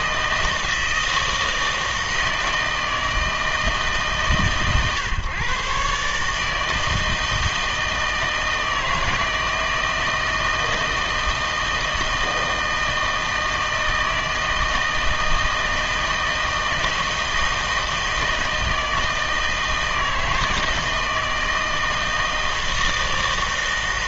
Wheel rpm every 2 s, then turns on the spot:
160, 160, 130, 160, 160, 160, 160, 160, 160, 160, 160, 160.
none